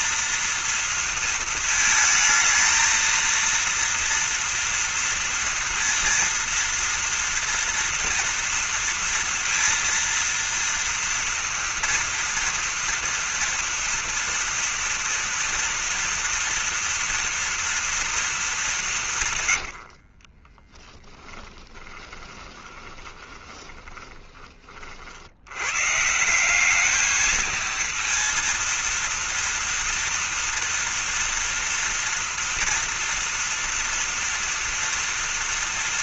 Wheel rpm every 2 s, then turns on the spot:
230, 220, 230, 230, 230, 230, 230, 230, 230, 210, 30, 20, 40, 200, 230, 230, 230, 230.
20-24